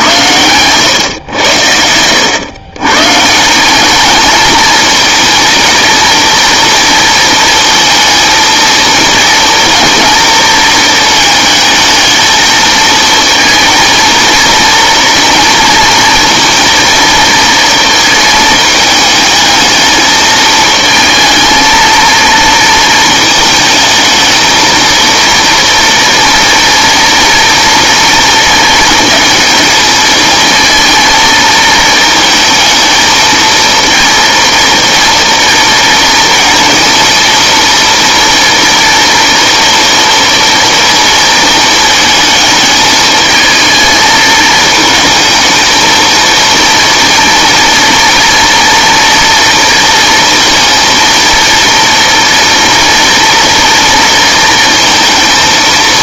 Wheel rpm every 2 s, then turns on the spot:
120, 120, 220, 230, 230, 220, 220, 230, 230, 220, 220, 220, 220, 230, 230, 230, 220, 230, 230, 230, 230, 220, 220, 230, 230, 230, 230, 230.
none